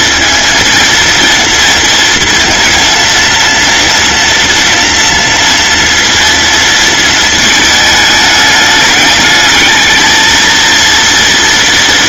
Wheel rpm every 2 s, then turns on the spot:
230, 230, 230, 230, 210, 230.
none